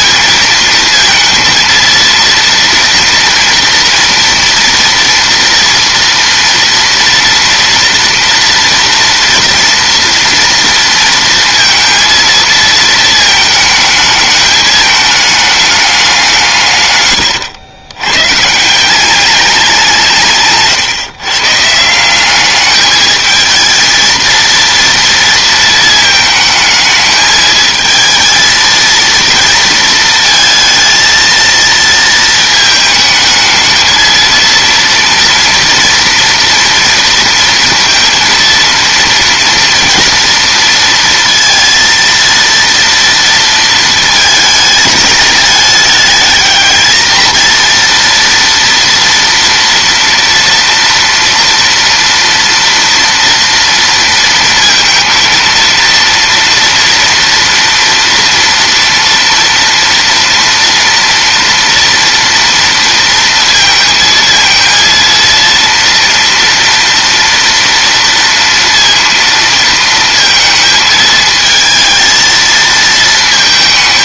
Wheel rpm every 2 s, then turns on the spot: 230, 230, 230, 230, 240, 230, 230, 210, 150, 150, 150, 210, 230, 220, 230, 230, 220, 230, 230, 230, 230, 230, 220, 220, 230, 230, 230, 230, 230, 230, 230, 230, 230, 230, 230, 220, 220.
none